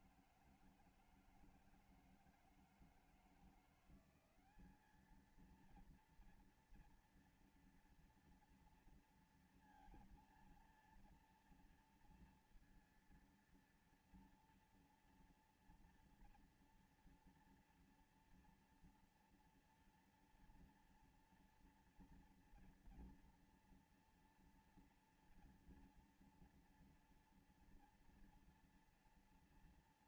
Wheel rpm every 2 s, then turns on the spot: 160, 160, 210, 230, 230, 230, 230, 230, 230, 230, 230, 240, 230, 230, 230.
none